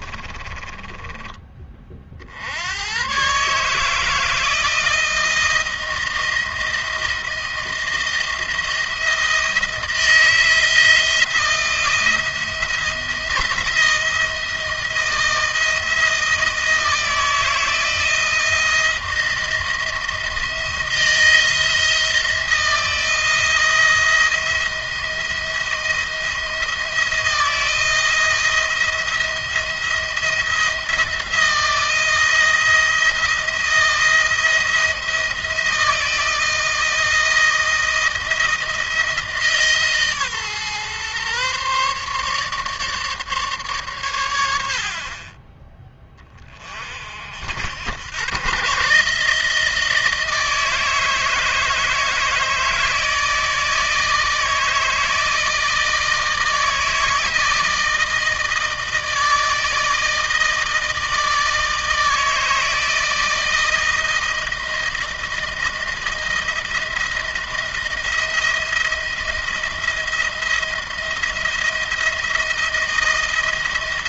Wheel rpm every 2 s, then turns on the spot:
30, 70, 160, 170, 170, 170, 170, 170, 160, 170, 160, 170, 170, 160, 170, 170, 170, 170, 160, 160, 130, 150, 70, 30, 120, 160, 160, 160, 160, 160, 160, 160, 160, 170, 170, 170, 170.
0-2